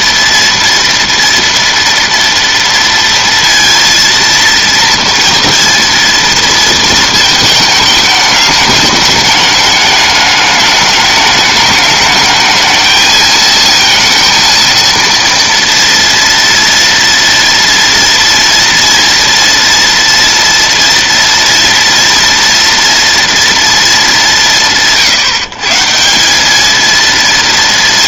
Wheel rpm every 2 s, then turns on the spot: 230, 230, 230, 230, 210, 210, 220, 230, 230, 230, 230, 230, 120, 230.
none